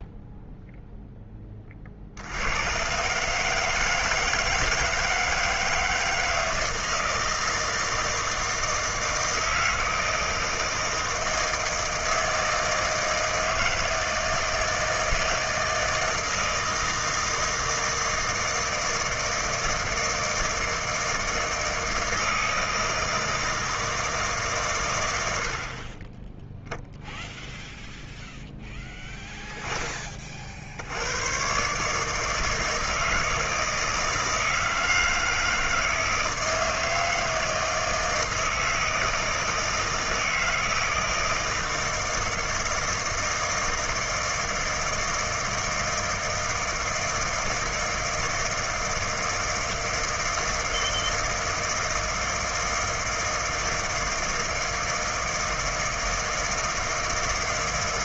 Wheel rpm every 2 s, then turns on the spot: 0, 110, 160, 160, 160, 160, 160, 160, 160, 160, 160, 160, 130, 0, 0, 70, 160, 160, 160, 160, 160, 160, 160, 160, 160, 160, 160, 160, 160.
none